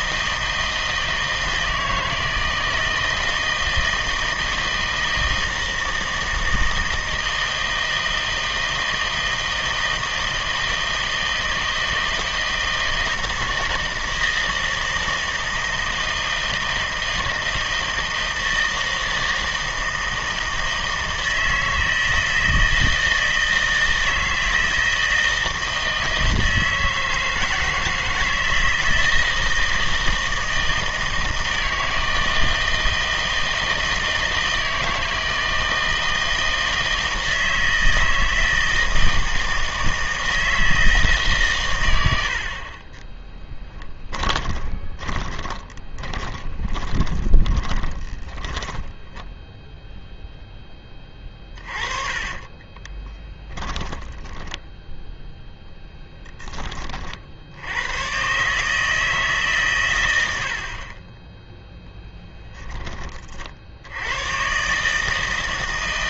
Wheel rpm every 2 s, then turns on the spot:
160, 160, 170, 160, 160, 160, 160, 160, 160, 160, 160, 160, 160, 160, 160, 160, 160, 160, 160, 160, 160, 40, 20, 20, 10, 10, 20, 10, 20, 150, 60, 10, 140.
44-50 52-56